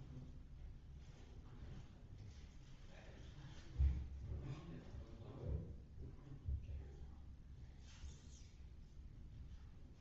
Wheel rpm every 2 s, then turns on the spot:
0, 0, 0, 0, 0.
none